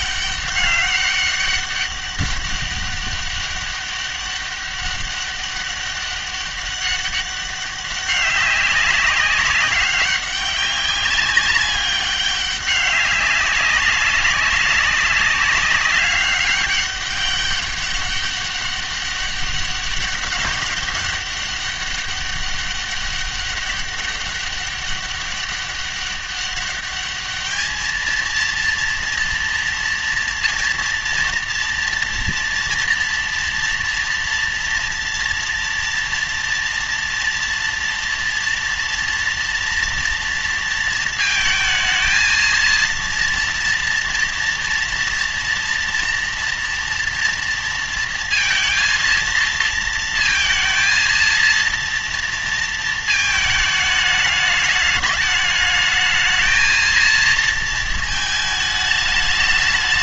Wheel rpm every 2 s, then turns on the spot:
200, 200, 200, 200, 200, 200, 200, 200, 200, 200, 200, 200, 200, 200, 230, 230, 230, 230, 230, 230, 230, 230, 230, 230, 230, 230, 230, 210, 220, 210.
none